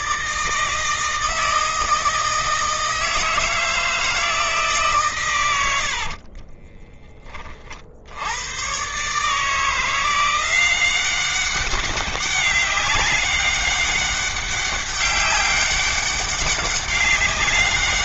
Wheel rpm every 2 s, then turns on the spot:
160, 160, 140, 20, 120, 190, 200, 200, 200.
6-8